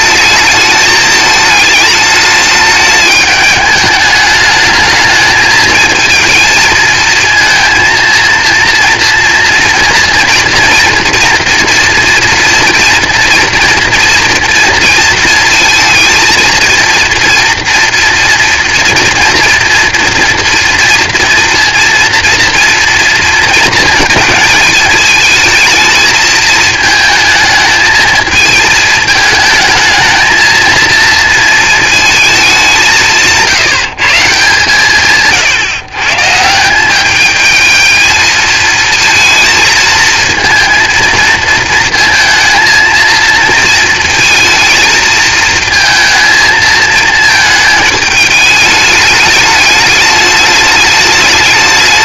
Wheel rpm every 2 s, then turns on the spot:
210, 210, 220, 220, 230, 230, 230, 230, 230, 230, 230, 230, 220, 220, 220, 230, 200, 140, 180, 220, 230, 230, 230, 220, 210, 210.
none